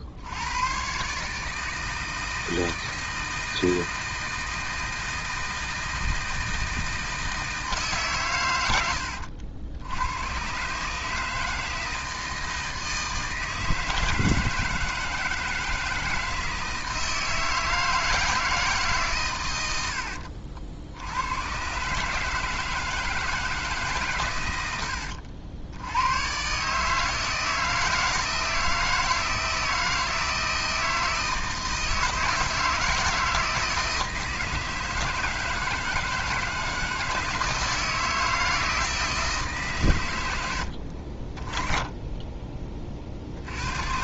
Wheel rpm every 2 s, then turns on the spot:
100, 160, 160, 160, 110, 130, 160, 160, 160, 160, 70, 160, 110, 130, 160, 160, 160, 160, 160, 160, 80, 20.
none